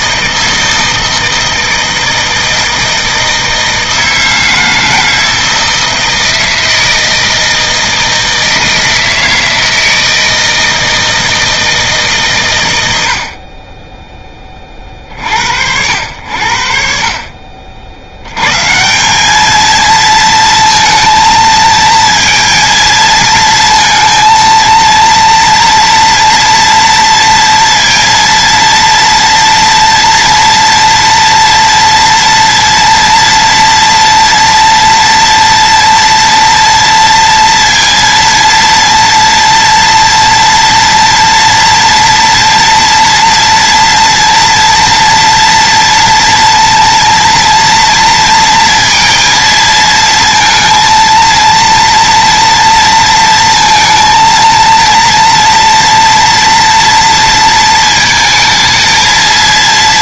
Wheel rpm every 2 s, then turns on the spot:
160, 160, 160, 160, 160, 160, 110, 30, 60, 140, 230, 230, 230, 230, 230, 230, 230, 230, 230, 230, 230, 230, 230, 230, 230, 230, 230, 230, 230, 220.
none